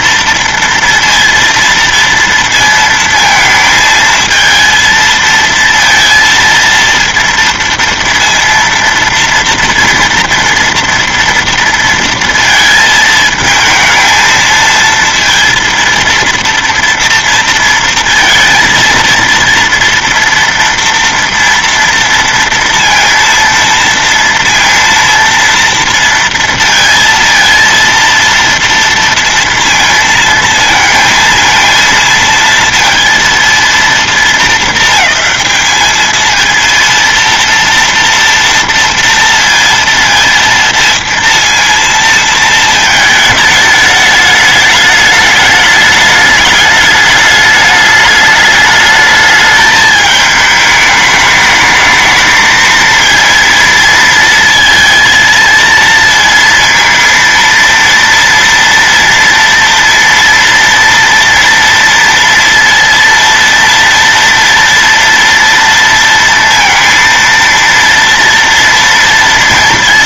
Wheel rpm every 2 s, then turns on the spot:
230, 230, 230, 230, 230, 230, 230, 230, 230, 230, 230, 230, 230, 230, 230, 220, 230, 220, 230, 230, 230, 220, 210, 210, 210, 210, 220, 230, 230, 230, 230, 230, 230, 230, 230.
none